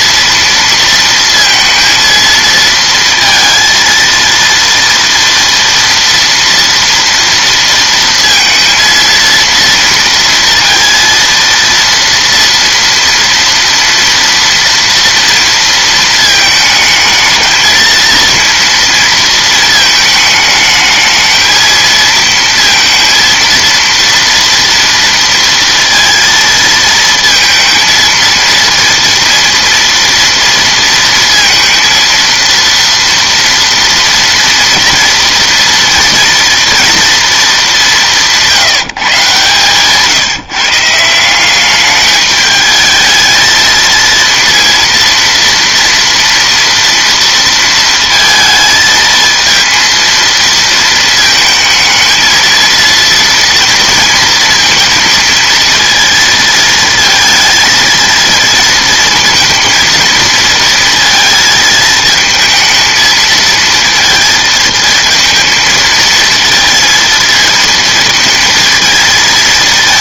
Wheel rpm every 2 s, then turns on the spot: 230, 230, 230, 230, 230, 230, 230, 230, 220, 230, 220, 230, 230, 230, 230, 230, 230, 230, 230, 140, 150, 220, 230, 230, 220, 230, 230, 230, 220, 230, 230, 220, 220, 230, 220.
none